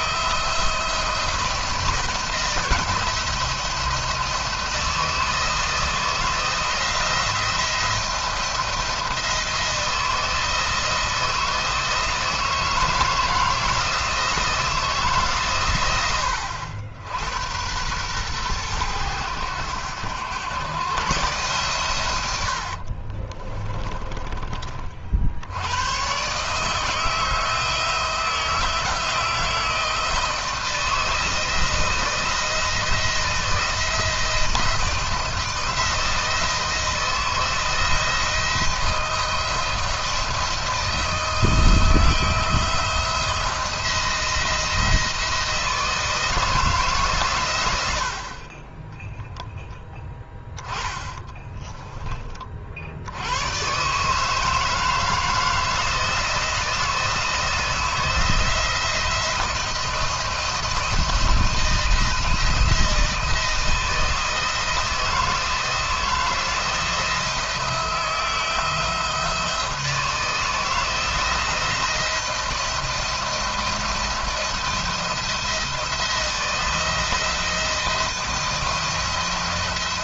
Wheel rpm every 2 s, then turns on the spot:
160, 170, 160, 170, 160, 160, 170, 140, 90, 100, 130, 30, 70, 160, 160, 160, 170, 170, 160, 170, 170, 170, 160, 150, 10, 10, 110, 160, 170, 170, 170, 160, 160, 170, 160, 160, 170, 170, 170, 170.
22-24 50-52